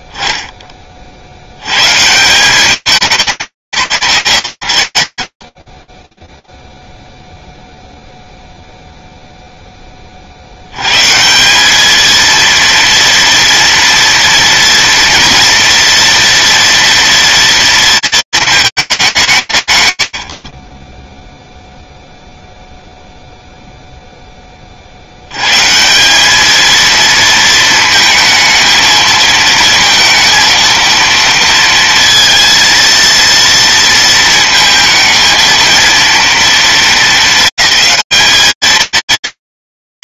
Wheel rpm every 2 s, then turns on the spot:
20, 200, 130, 0, 0, 130, 230, 230, 230, 200, 20, 0, 130, 220, 230, 230, 230, 230, 220, 230.
none